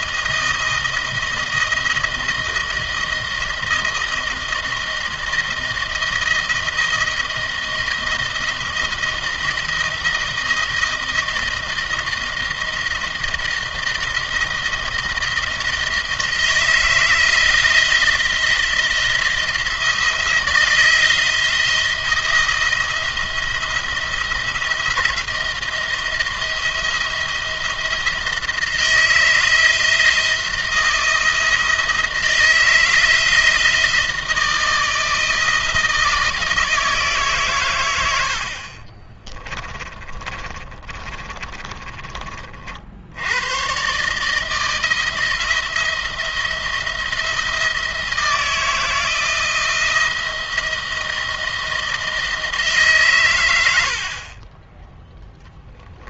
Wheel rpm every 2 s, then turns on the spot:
160, 160, 160, 160, 160, 170, 170, 170, 160, 170, 160, 170, 160, 170, 160, 170, 160, 160, 160, 40, 30, 50, 160, 170, 170, 170, 150, 20.
38-42